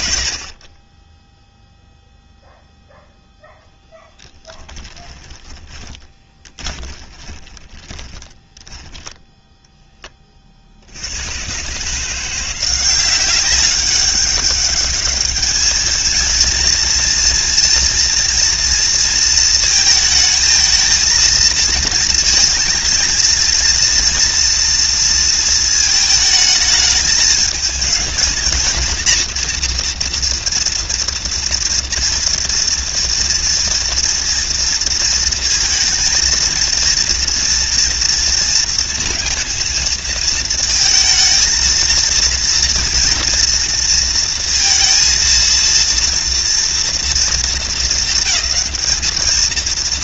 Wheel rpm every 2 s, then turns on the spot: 40, 0, 10, 20, 10, 80, 180, 200, 230, 230, 220, 230, 230, 210, 230, 230, 230, 230, 230, 230, 230, 230, 230, 230, 220.
4-10